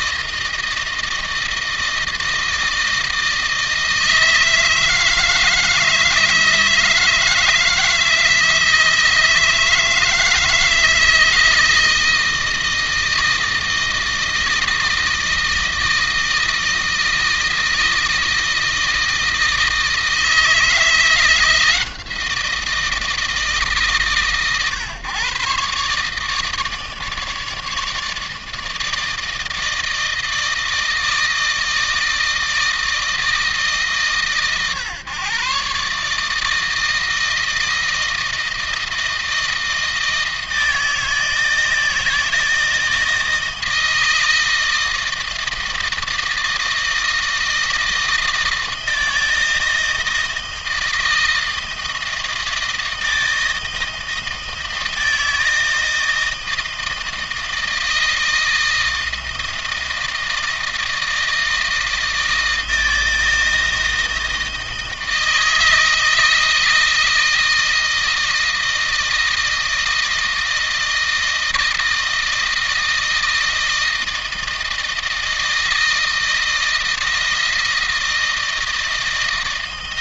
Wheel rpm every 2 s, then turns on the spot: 160, 160, 160, 160, 160, 160, 160, 160, 160, 160, 170, 170, 130, 150, 160, 160, 160, 130, 160, 160, 160, 160, 160, 160, 160, 160, 160, 160, 160, 160, 160, 160, 160, 160, 160, 160, 160, 160, 160, 160.
none